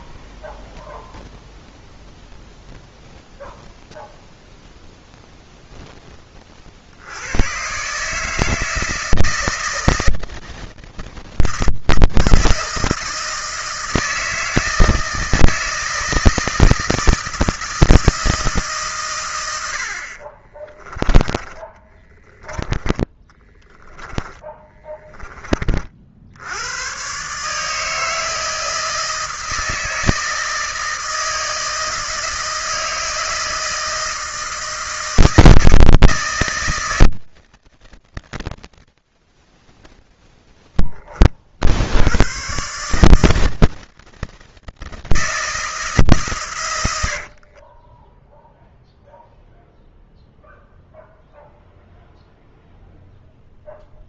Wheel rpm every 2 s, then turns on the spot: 0, 0, 0, 60, 160, 160, 160, 160, 160, 140, 30, 20, 20, 120, 160, 160, 160, 160, 160, 70, 20, 140, 160, 100, 0, 0, 0.
46-48